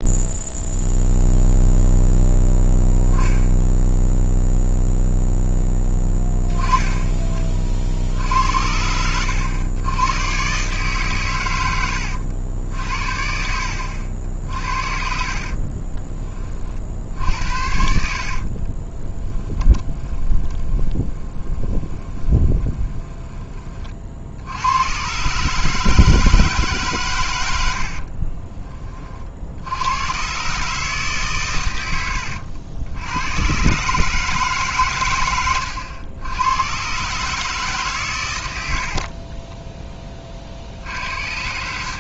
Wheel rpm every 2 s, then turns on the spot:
0, 0, 0, 10, 80, 130, 70, 60, 40, 30, 20, 20, 80, 140, 20, 140, 90, 150, 110, 90, 60.
14-16 18-24